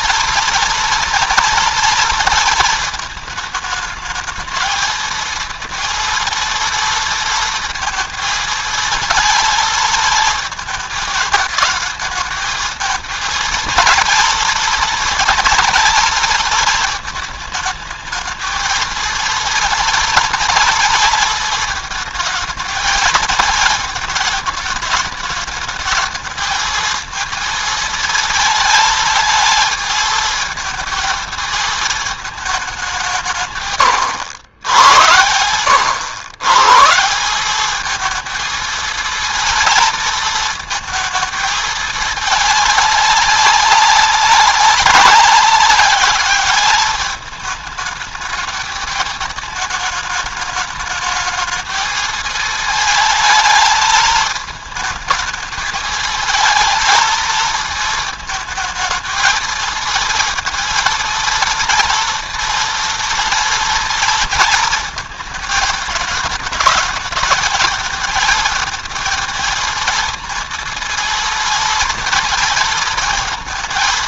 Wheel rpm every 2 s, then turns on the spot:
230, 220, 220, 230, 230, 220, 220, 230, 220, 230, 230, 220, 210, 220, 220, 220, 180, 100, 160, 230, 220, 200, 190, 210, 220, 220, 220, 220, 220, 220, 230, 230, 230, 220, 220, 220, 230.
none